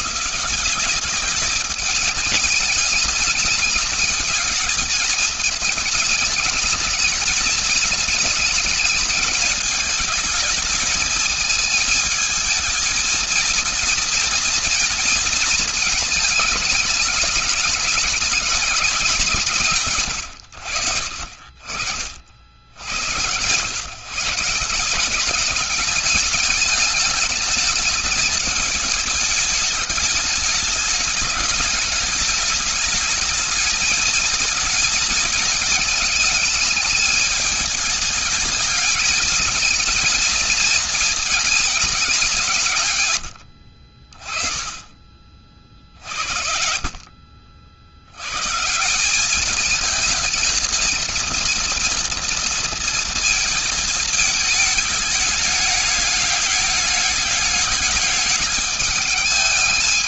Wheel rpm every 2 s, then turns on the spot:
180, 210, 220, 220, 220, 220, 220, 230, 210, 210, 100, 60, 150, 210, 210, 210, 210, 220, 210, 210, 220, 170, 30, 40, 120, 220, 230, 210, 210, 210.
46-48